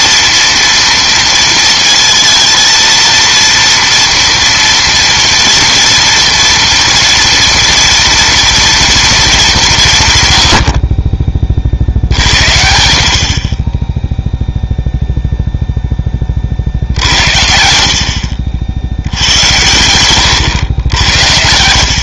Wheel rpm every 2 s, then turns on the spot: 230, 230, 230, 230, 230, 80, 70, 0, 50, 70, 110.
none